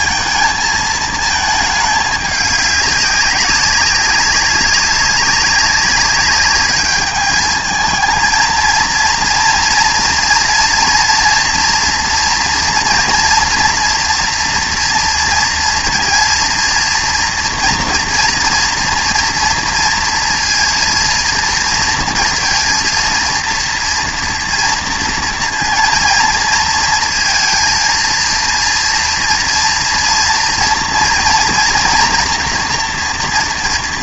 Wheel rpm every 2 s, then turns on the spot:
220, 200, 190, 200, 230, 230, 230, 230, 230, 240, 230, 230, 230, 220, 230, 240, 230.
none